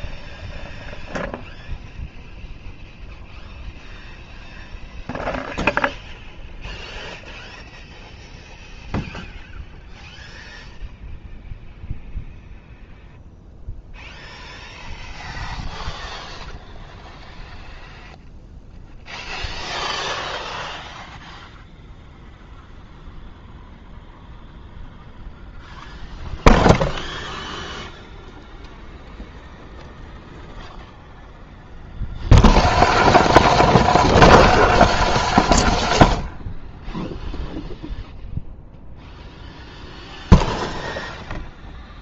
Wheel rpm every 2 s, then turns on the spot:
0, 0, 0, 0, 0, 0, 0, 0, 0, 0, 0, 0, 0, 0, 0, 0, 0, 0, 0, 0, 0.
none